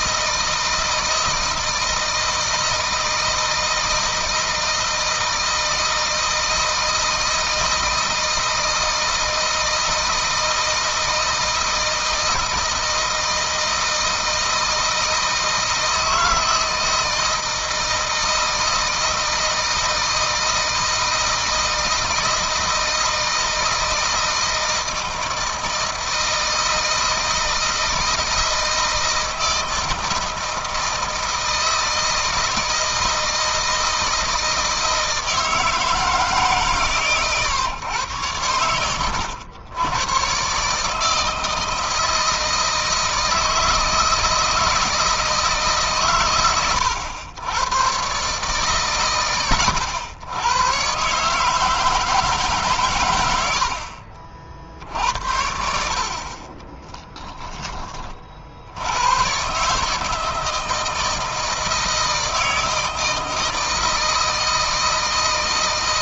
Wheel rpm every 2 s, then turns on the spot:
160, 160, 160, 160, 160, 160, 160, 160, 160, 160, 160, 160, 160, 160, 160, 160, 160, 160, 150, 110, 140, 160, 160, 100, 140, 120, 140, 50, 30, 60, 160, 160, 160.
56-58